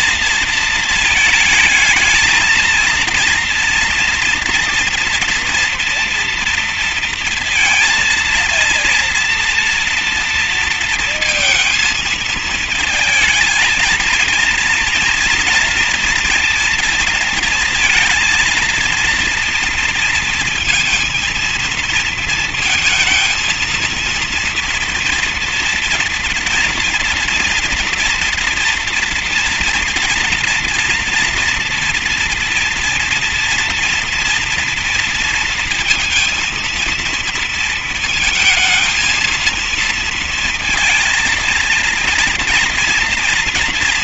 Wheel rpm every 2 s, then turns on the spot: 230, 220, 230, 230, 230, 230, 220, 230, 230, 220, 230, 220, 230, 230, 230, 240, 230, 230, 230, 230, 230, 230.
none